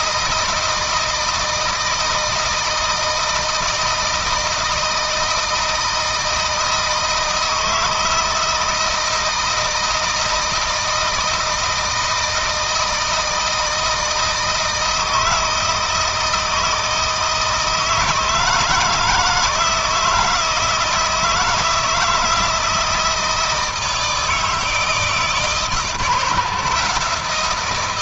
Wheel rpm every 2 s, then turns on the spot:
160, 160, 160, 160, 160, 160, 160, 160, 160, 160, 160, 160, 160, 140.
none